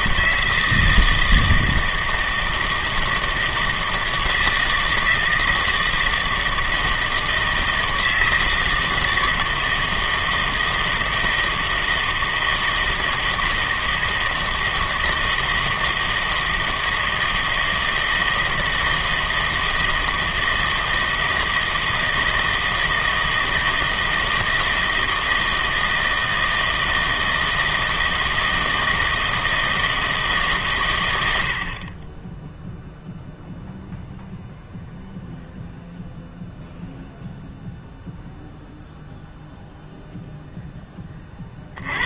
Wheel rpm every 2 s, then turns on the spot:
160, 160, 160, 160, 160, 160, 160, 160, 160, 160, 160, 160, 160, 160, 160, 140, 0, 0, 0, 0, 10.
none